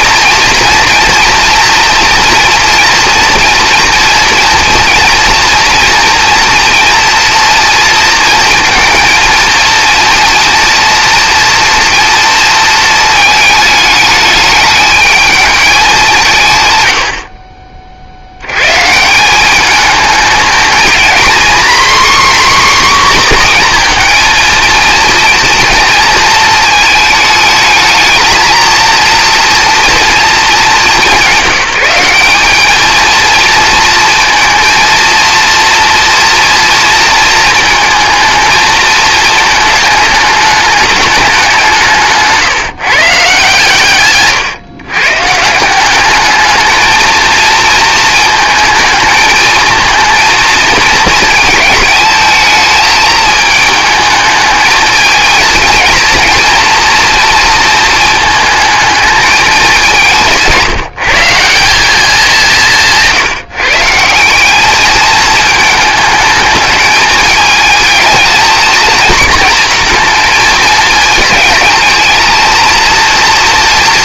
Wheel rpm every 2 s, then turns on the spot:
240, 230, 230, 240, 230, 230, 220, 220, 60, 160, 240, 260, 230, 220, 230, 210, 230, 230, 230, 220, 210, 140, 140, 220, 220, 220, 220, 220, 230, 220, 160, 150, 220, 210, 220, 220, 230.
none